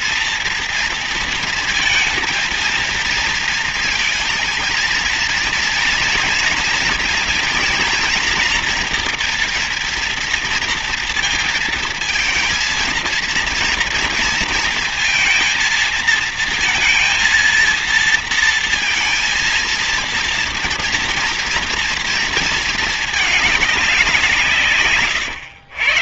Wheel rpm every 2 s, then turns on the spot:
230, 230, 230, 230, 230, 230, 230, 230, 230, 230, 230, 230, 170.
none